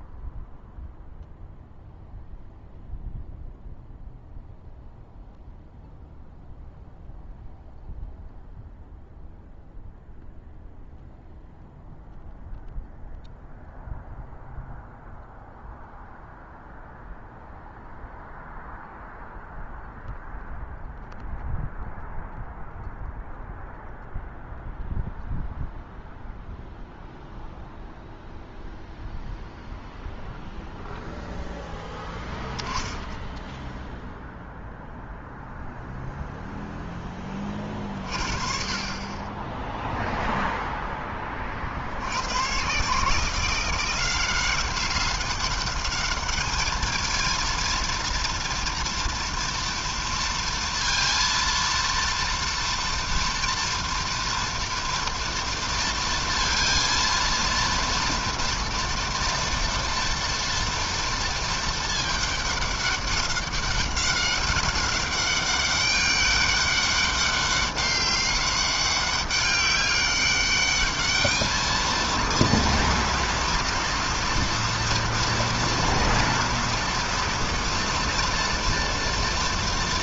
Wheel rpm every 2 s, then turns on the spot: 0, 0, 0, 0, 0, 0, 0, 0, 0, 0, 0, 0, 0, 0, 0, 0, 10, 0, 20, 20, 30, 160, 200, 230, 230, 230, 230, 230, 230, 240, 230, 200, 200, 200, 200, 220, 230, 230, 230, 230.
none